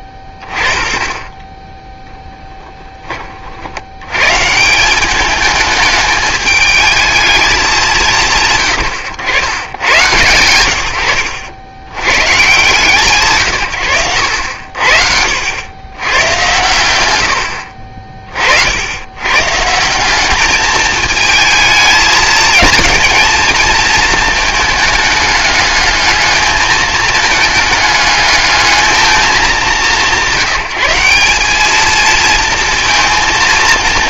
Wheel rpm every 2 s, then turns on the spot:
20, 10, 150, 210, 100, 110, 150, 80, 80, 60, 210, 220, 220, 220, 210, 170, 230.
2-4